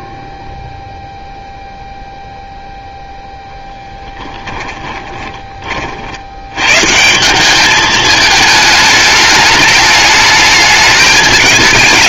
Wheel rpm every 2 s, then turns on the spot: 0, 0, 10, 120, 210, 220.
4-6